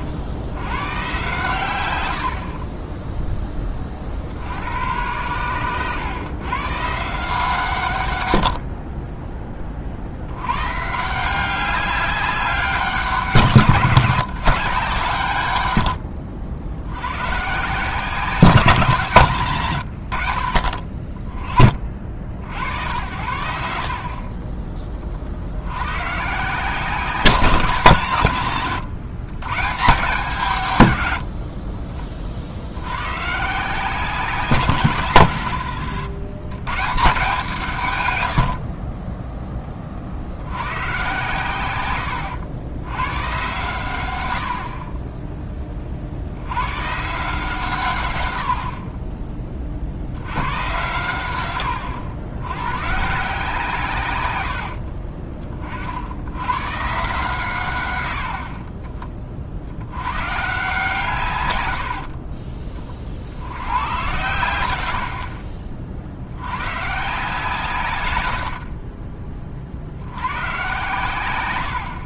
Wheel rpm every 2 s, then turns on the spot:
110, 30, 90, 140, 40, 140, 190, 140, 90, 170, 50, 80, 30, 170, 130, 120, 90, 150, 140, 40, 100, 110, 40, 120, 40, 110, 130, 60, 120, 30, 150, 40, 80, 130, 40, 110.
none